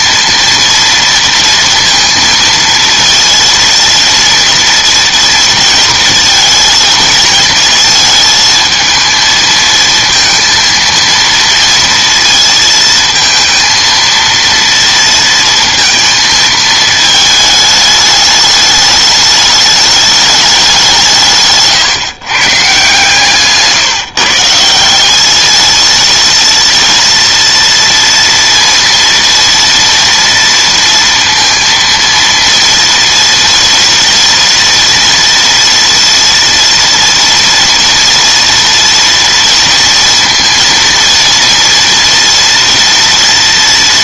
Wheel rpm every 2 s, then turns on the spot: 230, 230, 230, 220, 220, 230, 220, 230, 220, 210, 190, 130, 170, 230, 230, 230, 230, 230, 230, 230, 230, 230.
none